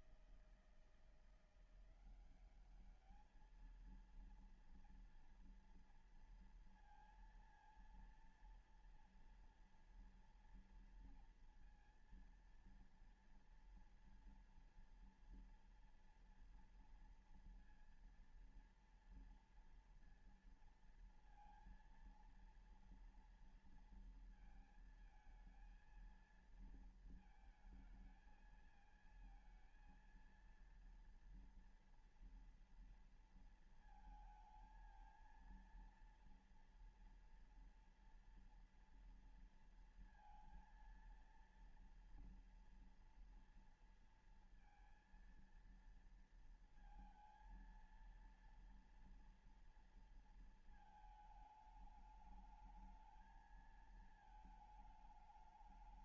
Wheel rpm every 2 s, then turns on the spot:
160, 190, 230, 230, 230, 230, 230, 230, 240, 230, 230, 230, 230, 230, 220, 230, 230, 220, 230, 230, 230, 230, 230, 230, 230, 220, 210, 220.
none